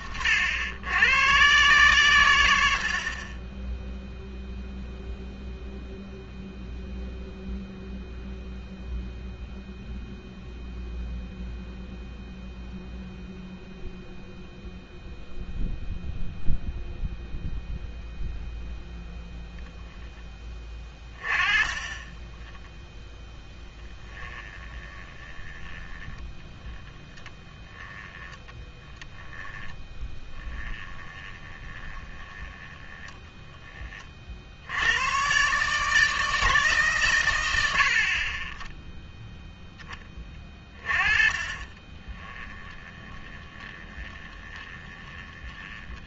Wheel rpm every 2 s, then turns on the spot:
100, 80, 0, 0, 0, 0, 0, 0, 0, 0, 20, 10, 20, 10, 20, 10, 10, 70, 150, 0, 40, 20, 20.
22-34 40-46